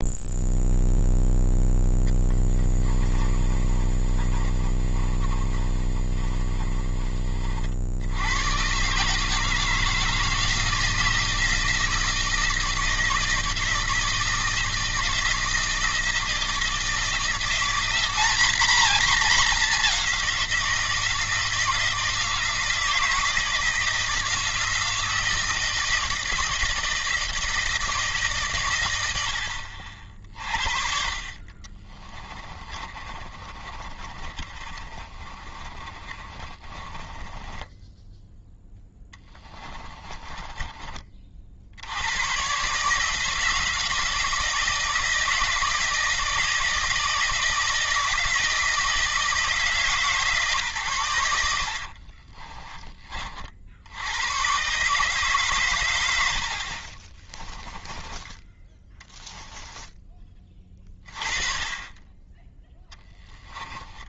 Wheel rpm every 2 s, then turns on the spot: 0, 20, 30, 30, 140, 160, 160, 170, 170, 230, 170, 160, 160, 160, 110, 50, 30, 30, 20, 10, 30, 150, 160, 160, 160, 100, 30, 140, 30, 10, 20, 10.
2-6 32-40 56-58 62-64